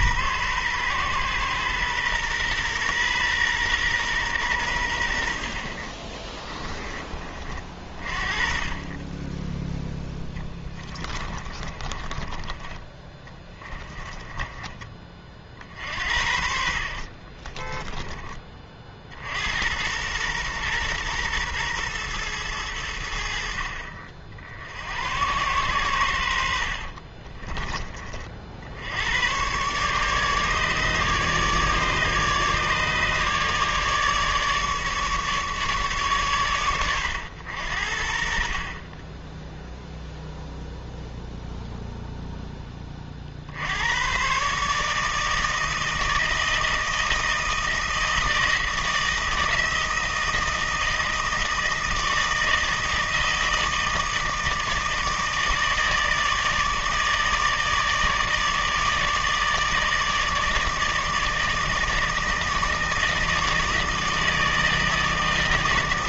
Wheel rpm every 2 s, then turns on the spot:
120, 120, 100, 20, 30, 20, 20, 20, 50, 40, 120, 100, 70, 60, 70, 150, 150, 150, 100, 30, 0, 20, 150, 160, 160, 160, 160, 160, 160, 150, 150, 160, 160.
10-12 16-18 26-28